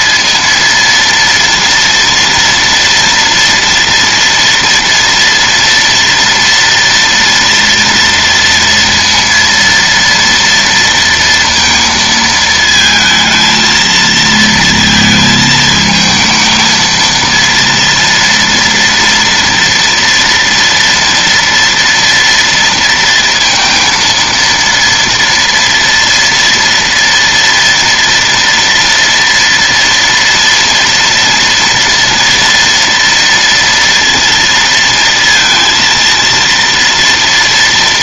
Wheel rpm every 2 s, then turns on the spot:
230, 230, 230, 230, 230, 230, 220, 230, 230, 230, 230, 230, 230, 230, 230, 230, 230, 230, 230.
none